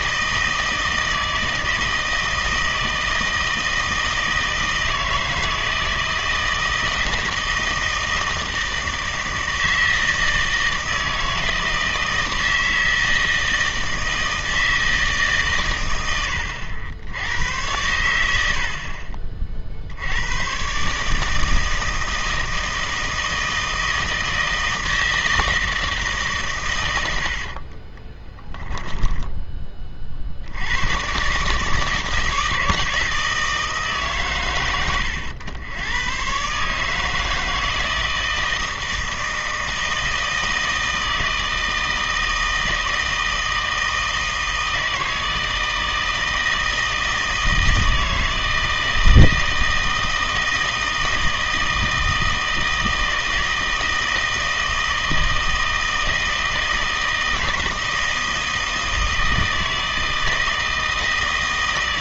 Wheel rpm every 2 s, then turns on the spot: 160, 160, 160, 160, 160, 160, 160, 160, 80, 70, 130, 160, 160, 120, 10, 90, 160, 100, 150, 160, 160, 160, 160, 160, 160, 160, 160, 160, 160, 160, 160.
28-30